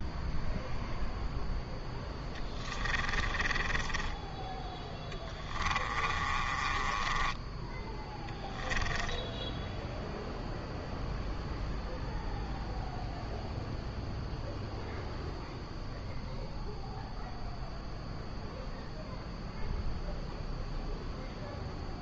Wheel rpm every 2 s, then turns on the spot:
0, 20, 10, 20, 10, 0, 0, 0, 0, 0, 0.
2-4 6-10